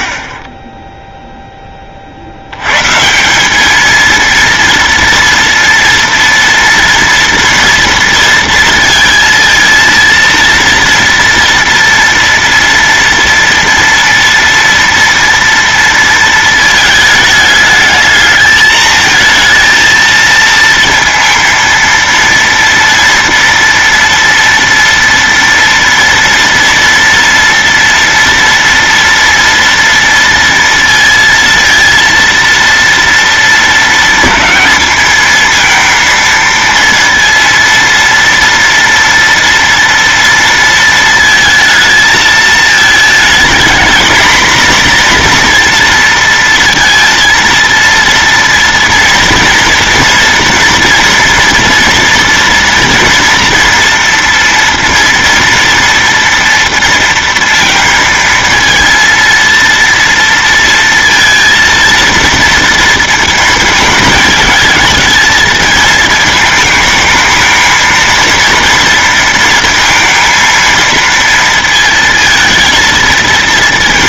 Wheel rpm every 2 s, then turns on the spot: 10, 120, 230, 230, 230, 230, 230, 230, 220, 220, 230, 230, 230, 230, 240, 230, 230, 220, 230, 230, 230, 220, 230, 230, 230, 230, 230, 230, 230, 230, 230, 230, 220, 220, 230, 230, 230.
none